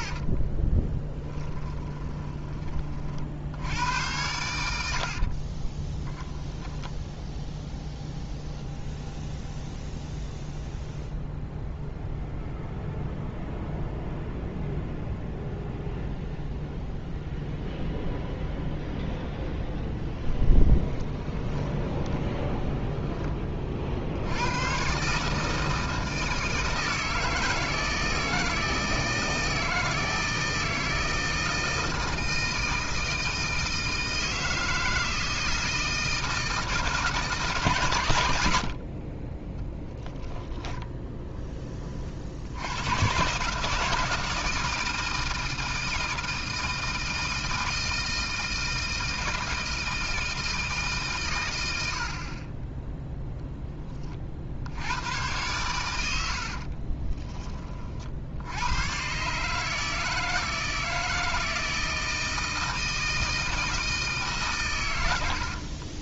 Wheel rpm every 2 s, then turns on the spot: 20, 30, 80, 10, 0, 0, 0, 0, 0, 0, 10, 10, 110, 160, 160, 160, 160, 160, 160, 60, 0, 100, 160, 160, 160, 150, 10, 90, 40, 110, 160, 160, 120.
0-2 6-8 20-24 56-58